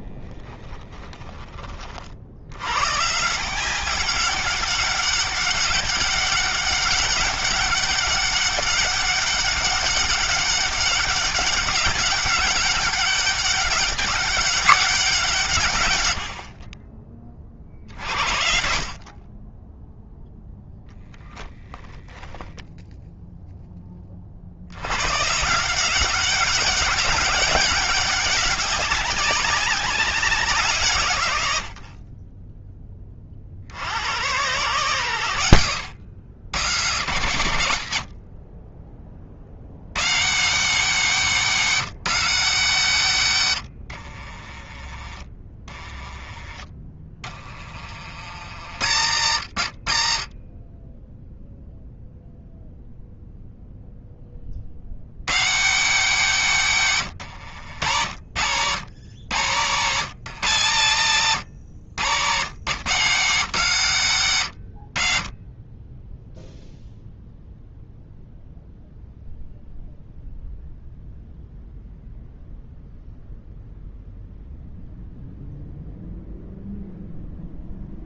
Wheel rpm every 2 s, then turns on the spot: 20, 130, 200, 200, 200, 200, 190, 180, 50, 40, 0, 0, 110, 190, 200, 150, 30, 120, 130, 40, 180, 140, 30, 30, 80, 10, 0, 60, 130, 90, 110, 140, 80, 0, 0, 0, 0, 0, 0.
0-2 44-48